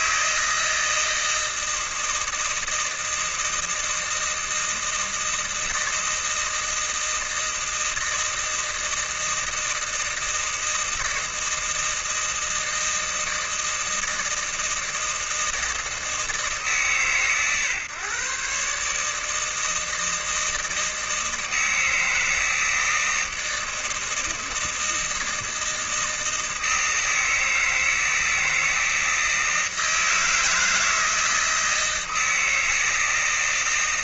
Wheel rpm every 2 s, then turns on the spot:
160, 160, 160, 160, 160, 160, 160, 160, 150, 150, 160, 160, 160, 160, 160, 160, 160.
none